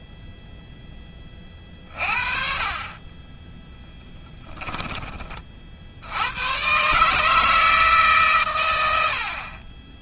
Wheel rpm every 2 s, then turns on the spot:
20, 30, 20, 130, 100.
none